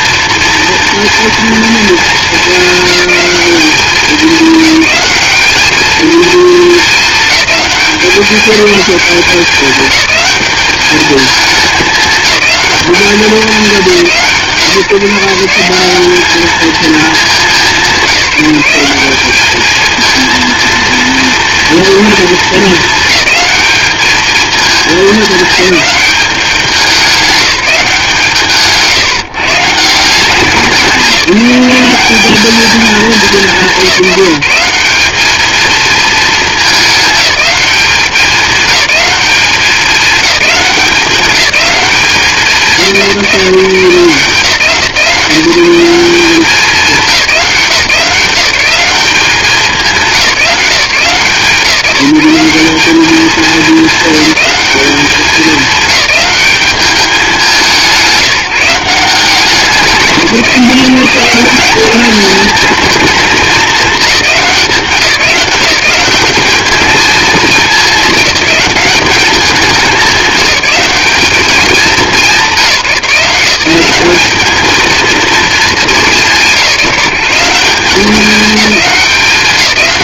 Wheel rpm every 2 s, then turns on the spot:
230, 210, 210, 210, 190, 210, 200, 150, 200, 200, 230, 210, 210, 190, 160, 180, 200, 210, 210, 190, 200, 160, 170, 180, 200, 160, 210, 210, 200, 190, 190, 210, 180, 220, 200, 210, 180, 220, 180, 200.
none